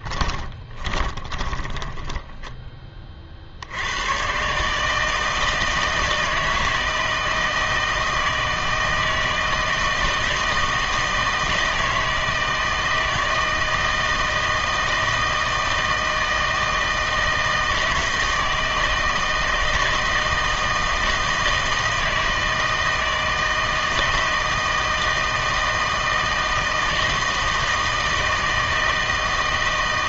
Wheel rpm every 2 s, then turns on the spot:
30, 20, 150, 160, 160, 160, 160, 160, 160, 160, 160, 160, 160, 160, 160.
0-2